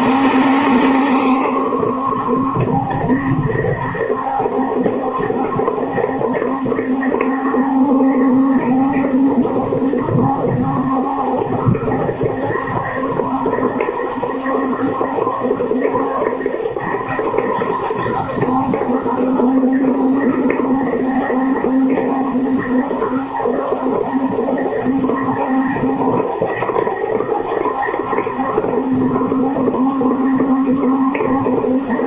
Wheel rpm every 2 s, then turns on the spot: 70, 70, 70, 70, 70, 70, 70, 70, 70, 70, 70, 70, 70, 70, 70, 70.
none